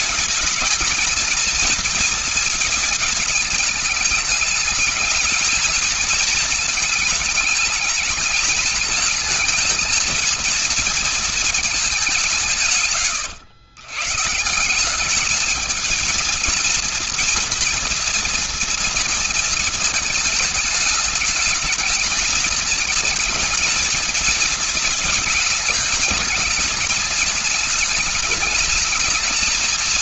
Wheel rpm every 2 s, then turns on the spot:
220, 220, 220, 220, 210, 230, 150, 160, 230, 230, 220, 220, 220, 220, 220.
none